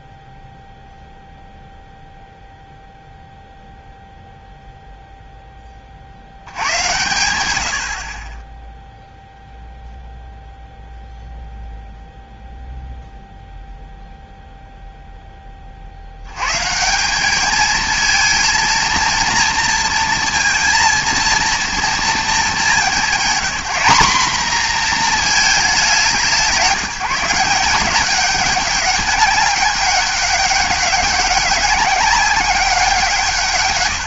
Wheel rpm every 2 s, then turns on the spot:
0, 0, 0, 100, 10, 0, 0, 0, 160, 230, 230, 210, 230, 180, 200, 200, 190.
none